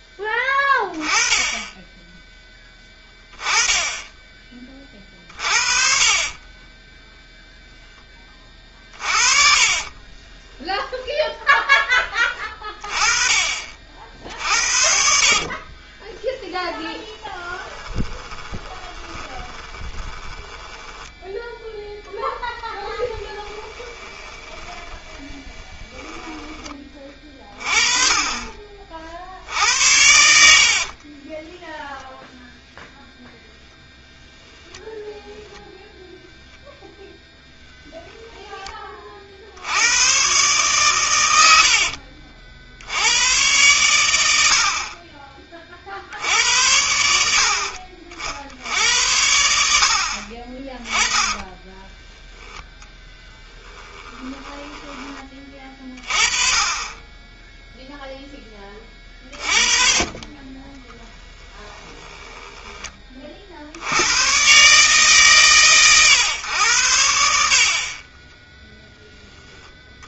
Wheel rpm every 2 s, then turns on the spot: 10, 10, 30, 10, 30, 0, 20, 50, 10, 20, 10, 20, 20, 20, 40, 50, 0, 10, 0, 20, 120, 90, 40, 90, 90, 40, 20, 20, 20, 30, 10, 20, 130, 90, 10.
6-10 14-26 30-32 34-36 50-52 60-62